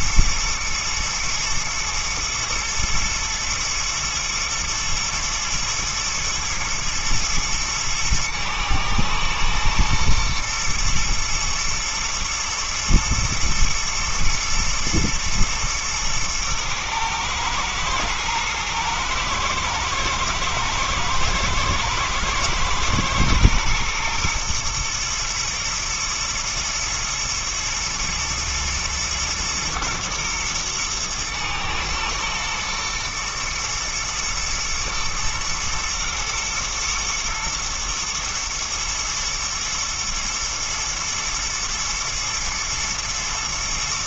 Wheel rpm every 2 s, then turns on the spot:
120, 110, 120, 110, 110, 110, 120, 120, 110, 120, 120, 120, 120, 110, 120, 110, 110, 120, 110, 110, 120, 120.
none